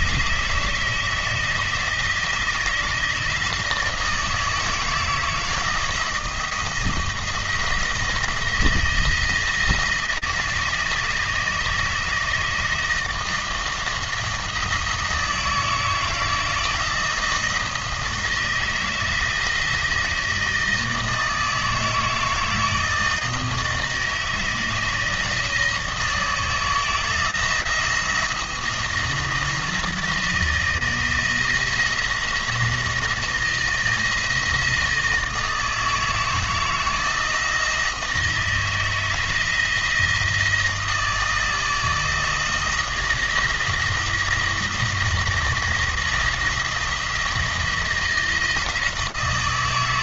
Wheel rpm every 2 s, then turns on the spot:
160, 160, 160, 170, 170, 160, 160, 160, 170, 160, 160, 160, 160, 160, 170, 160, 170, 160, 160, 160, 160, 160, 170, 160, 160.
none